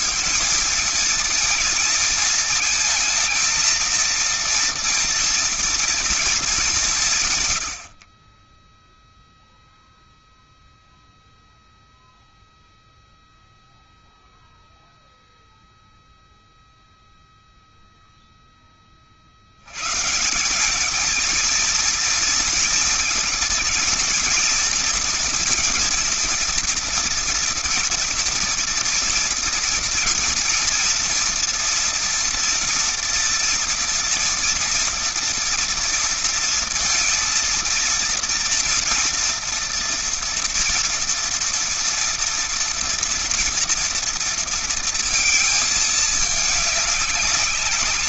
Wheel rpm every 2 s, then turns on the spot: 230, 230, 230, 200, 20, 0, 0, 0, 0, 10, 180, 230, 220, 230, 230, 230, 230, 230, 230, 230, 230, 230, 230, 210.
none